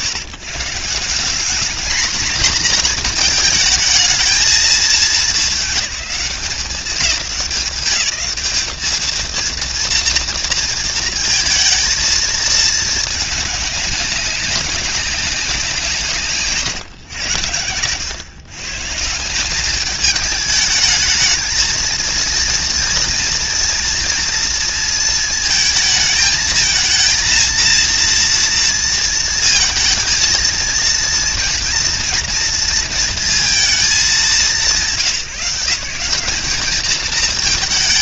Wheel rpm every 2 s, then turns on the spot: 140, 230, 220, 200, 200, 230, 220, 200, 140, 130, 210, 230, 230, 220, 230, 230, 230, 180, 200.
none